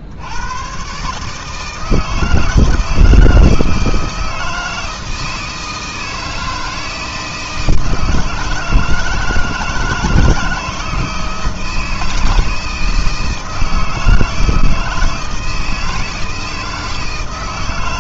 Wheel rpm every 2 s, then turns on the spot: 140, 160, 160, 160, 160, 160, 160, 160, 160.
none